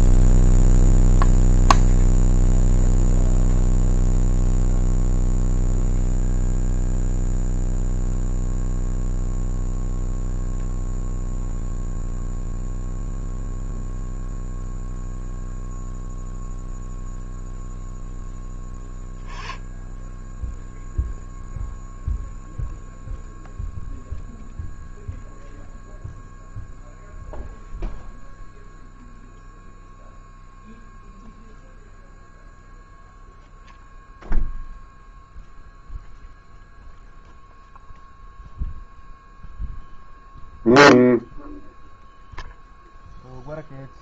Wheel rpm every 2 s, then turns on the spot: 0, 0, 0, 0, 0, 0, 0, 0, 0, 10, 0, 0, 0, 0, 0, 0, 0, 0, 0, 0, 0, 0.
none